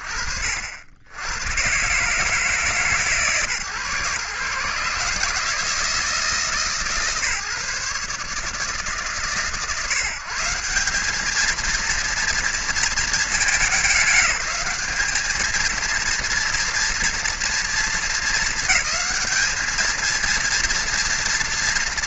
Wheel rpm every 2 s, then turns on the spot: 70, 140, 150, 150, 140, 210, 230, 210, 230, 210, 230.
none